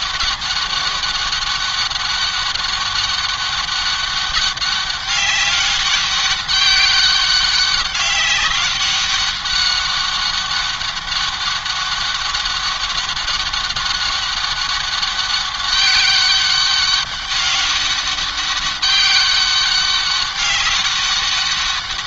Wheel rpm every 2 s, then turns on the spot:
200, 200, 200, 200, 200, 200, 200, 200, 190, 200, 200.
none